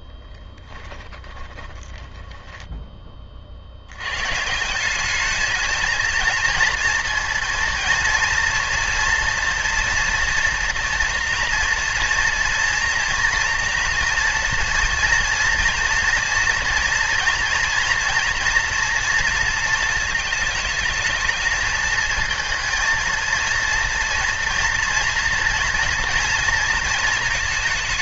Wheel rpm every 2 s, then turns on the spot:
10, 20, 180, 230, 230, 230, 230, 230, 230, 230, 220, 230, 230, 230.
0-2